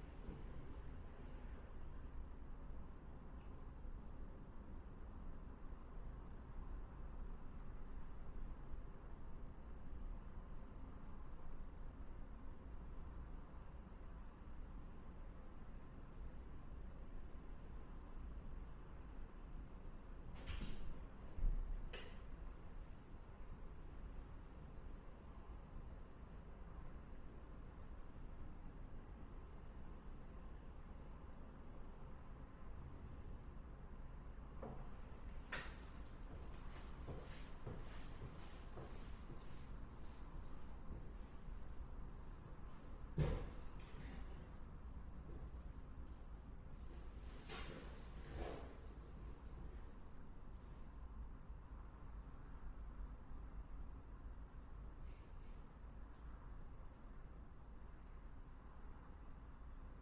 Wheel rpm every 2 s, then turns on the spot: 0, 0, 0, 0, 0, 0, 0, 0, 0, 0, 0, 0, 0, 0, 0, 0, 0, 0, 0, 0, 0, 0, 0, 0, 0, 0, 0, 0, 0, 0.
none